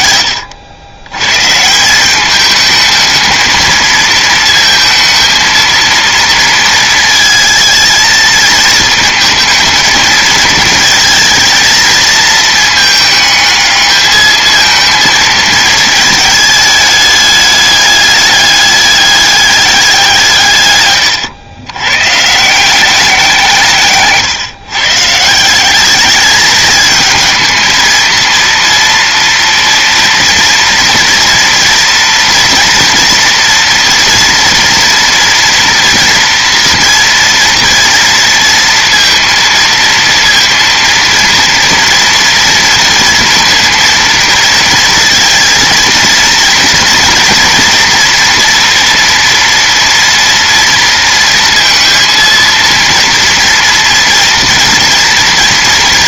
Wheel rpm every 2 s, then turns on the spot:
150, 220, 230, 220, 220, 220, 220, 220, 210, 200, 90, 160, 180, 220, 230, 230, 230, 240, 230, 230, 230, 230, 230, 230, 240, 230, 230, 240.
none